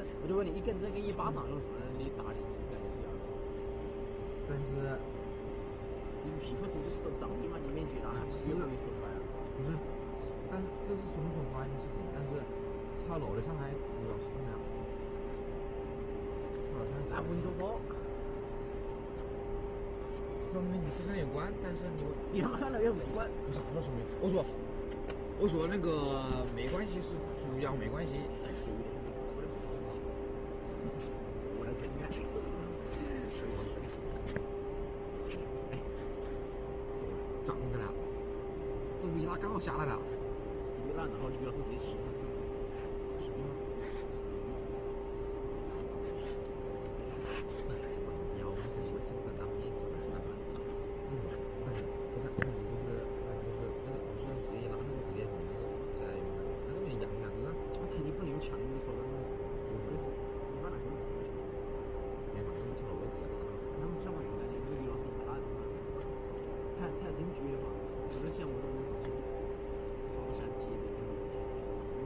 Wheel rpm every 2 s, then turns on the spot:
0, 0, 0, 0, 0, 0, 0, 0, 0, 0, 0, 0, 0, 0, 0, 0, 0, 0, 0, 0, 0, 0, 0, 0, 0, 0, 0, 0, 0, 0, 0, 0, 0, 0, 0, 0.
none